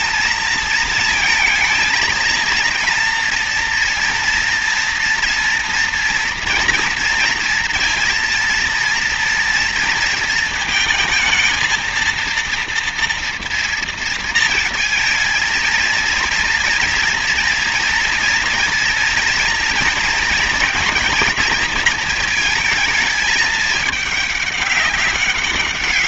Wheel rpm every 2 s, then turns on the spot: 220, 230, 230, 240, 230, 220, 230, 220, 230, 230, 230, 220, 200.
none